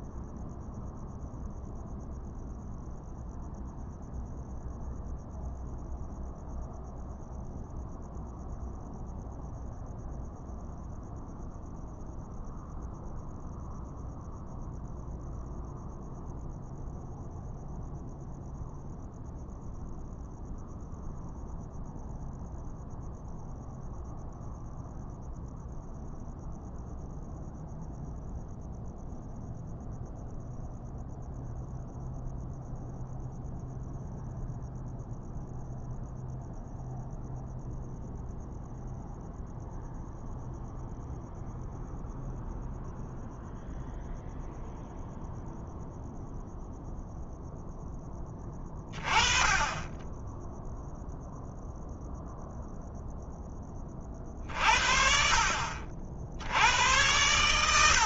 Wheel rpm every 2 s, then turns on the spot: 0, 0, 0, 0, 0, 0, 0, 0, 0, 0, 0, 0, 0, 0, 0, 0, 0, 0, 0, 0, 0, 0, 0, 0, 20, 0, 0, 40, 90.
none